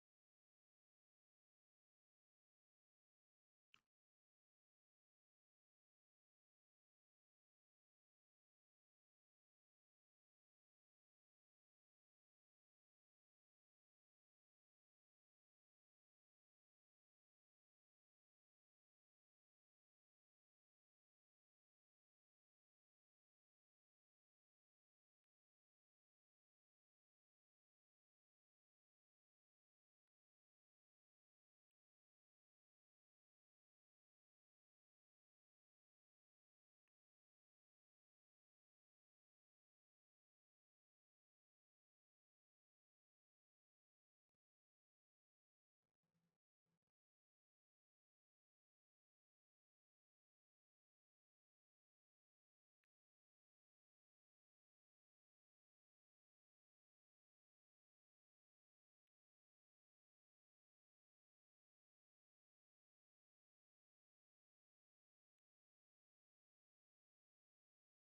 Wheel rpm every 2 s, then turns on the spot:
0, 0, 0, 0, 0, 0, 0, 0, 0, 0, 0, 0, 0, 0, 0, 0, 0, 0, 0, 0, 0, 0, 0, 0, 0, 0, 0, 0, 0, 0, 0, 0, 0, 0.
none